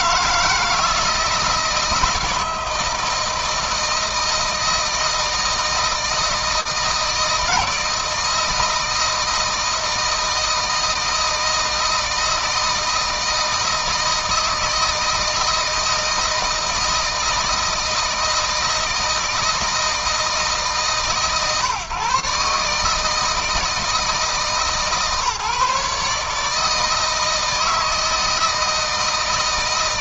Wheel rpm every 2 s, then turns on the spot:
160, 160, 160, 160, 160, 160, 160, 160, 170, 160, 150, 150, 150, 160, 160.
none